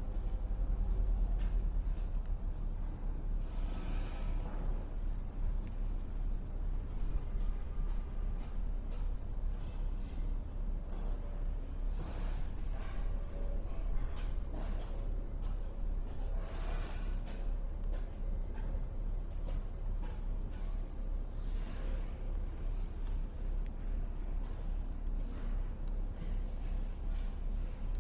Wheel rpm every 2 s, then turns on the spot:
0, 0, 0, 0, 0, 0, 0, 0, 0, 0, 0, 0, 0, 0.
none